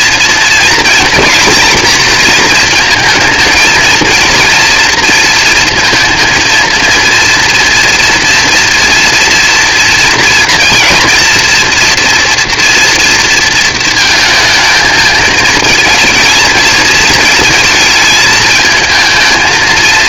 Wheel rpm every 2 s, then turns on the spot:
240, 230, 230, 230, 230, 230, 240, 220, 230, 220.
none